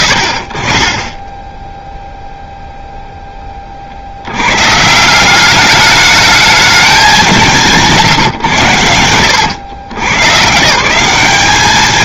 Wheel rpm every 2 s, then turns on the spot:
40, 0, 130, 210, 100, 140.
none